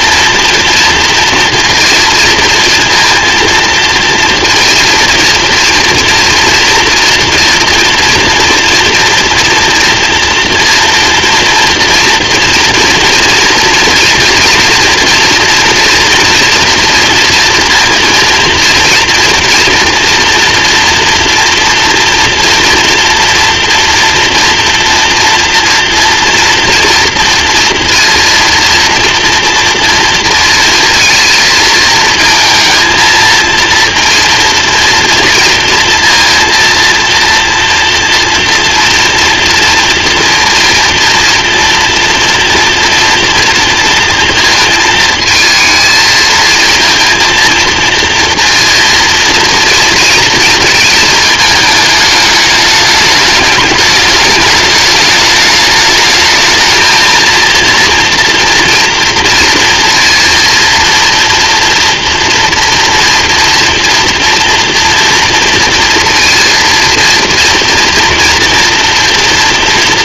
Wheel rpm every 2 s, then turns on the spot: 230, 230, 230, 240, 230, 230, 240, 230, 230, 230, 230, 240, 230, 230, 230, 230, 220, 230, 230, 240, 230, 230, 230, 220, 230, 230, 210, 210, 220, 230, 230, 230, 240, 230, 230.
none